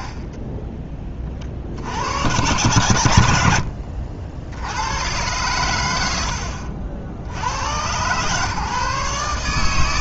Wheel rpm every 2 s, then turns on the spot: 30, 110, 80, 70, 130.
none